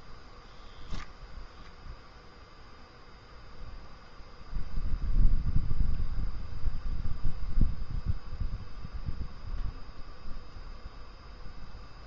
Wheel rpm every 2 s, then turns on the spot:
0, 0, 0, 0, 0, 0.
none